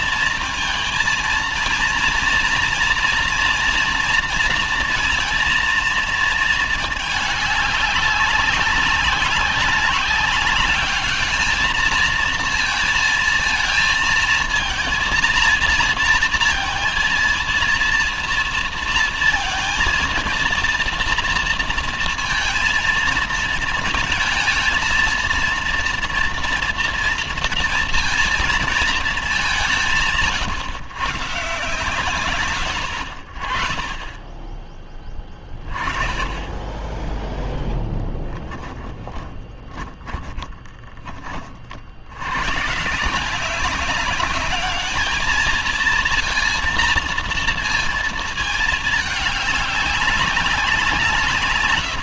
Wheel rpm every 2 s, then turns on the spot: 230, 230, 230, 220, 190, 200, 230, 230, 230, 230, 230, 230, 230, 230, 230, 130, 110, 20, 10, 20, 20, 130, 210, 230, 220, 180.
38-42